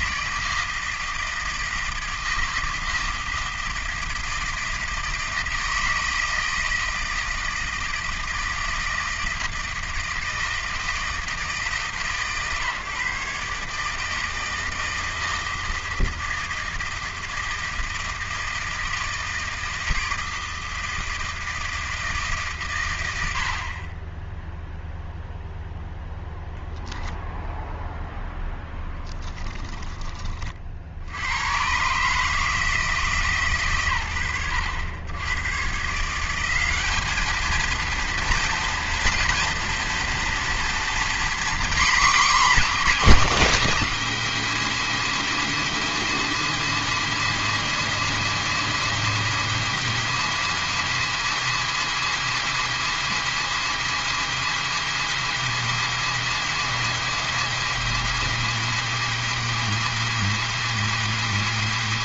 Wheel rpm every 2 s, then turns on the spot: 160, 160, 160, 160, 160, 160, 140, 160, 160, 160, 160, 120, 0, 0, 10, 60, 160, 90, 200, 230, 240, 270, 280, 280, 280, 280, 280, 280, 280, 280, 280.
28-30